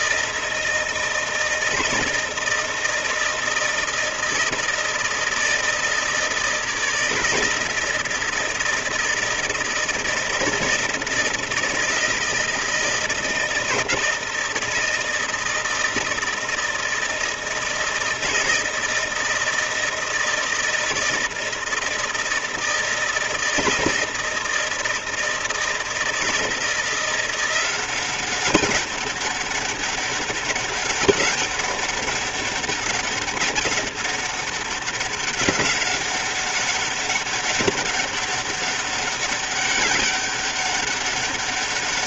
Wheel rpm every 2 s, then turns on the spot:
160, 160, 160, 160, 160, 160, 160, 160, 160, 160, 160, 160, 160, 170, 190, 190, 200, 190, 190, 200, 200.
none